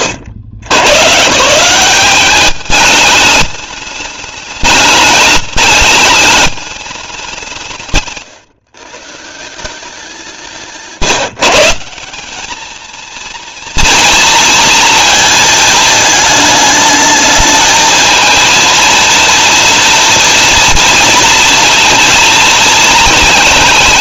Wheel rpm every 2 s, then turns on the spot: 100, 210, 210, 210, 140, 150, 220, 230, 220, 230, 230, 220.
none